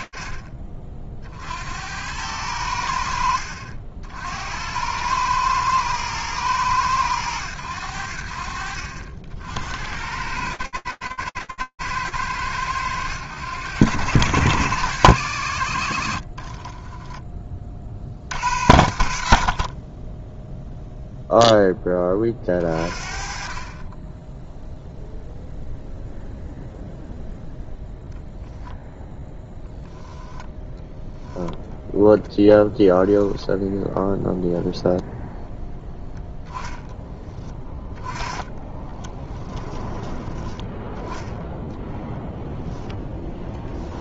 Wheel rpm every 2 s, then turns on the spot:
50, 70, 110, 80, 70, 100, 110, 40, 60, 10, 20, 0, 0, 10, 0, 10, 0, 10, 20, 10, 0, 110.
14-16 36-38